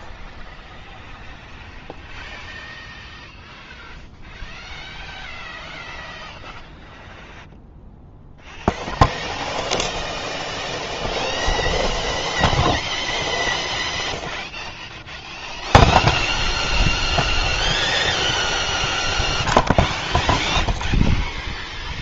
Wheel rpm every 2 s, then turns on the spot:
0, 0, 0, 0, 0, 0, 0, 0, 0, 0, 0.
none